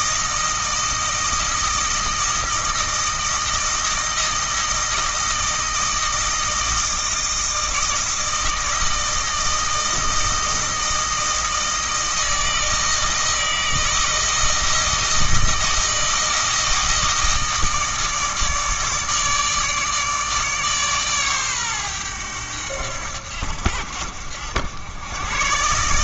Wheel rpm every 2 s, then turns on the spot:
160, 160, 160, 160, 160, 160, 160, 160, 160, 150, 140, 90, 90.
none